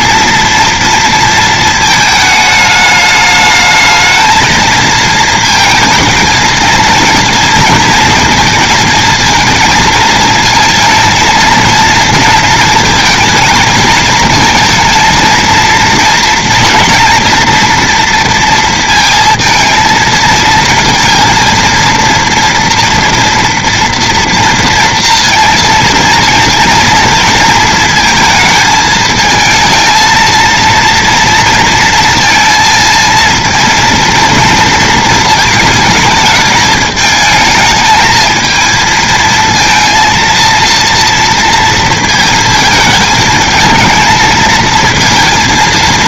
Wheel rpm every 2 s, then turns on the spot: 230, 210, 230, 230, 230, 220, 220, 230, 230, 230, 230, 230, 230, 230, 220, 230, 230, 230, 210, 220, 230, 220, 220.
none